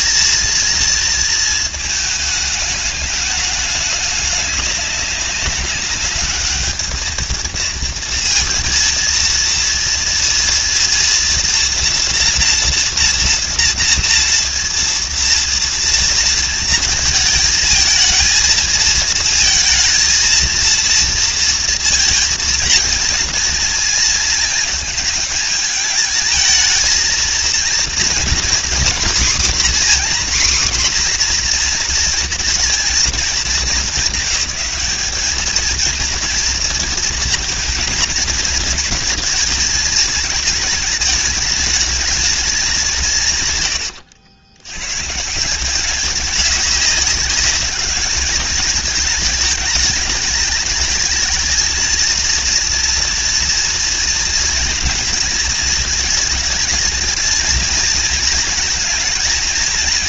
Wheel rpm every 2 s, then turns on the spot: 230, 210, 200, 220, 230, 230, 230, 230, 220, 230, 230, 230, 220, 220, 250, 250, 220, 220, 230, 220, 220, 160, 140, 200, 210, 220, 230, 230, 220, 230.
none